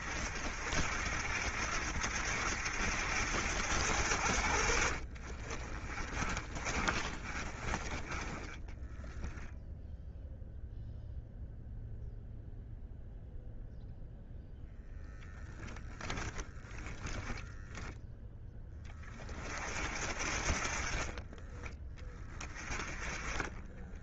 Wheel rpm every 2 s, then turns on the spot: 60, 70, 50, 30, 10, 0, 0, 0, 10, 20, 30, 20.
4-10